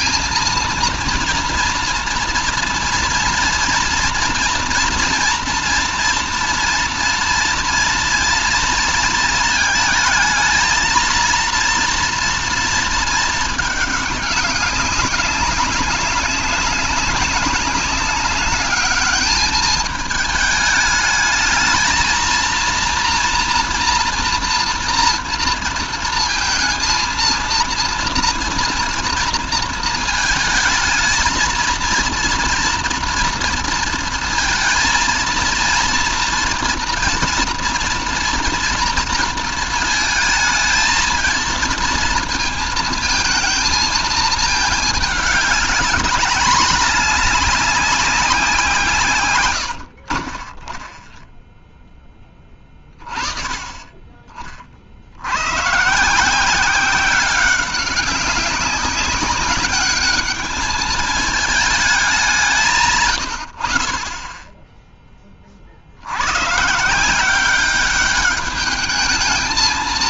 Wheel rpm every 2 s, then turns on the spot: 220, 230, 230, 240, 230, 220, 230, 200, 200, 210, 210, 230, 230, 230, 240, 220, 230, 230, 230, 230, 220, 220, 210, 210, 180, 30, 30, 50, 180, 190, 210, 160, 10, 130, 210.
none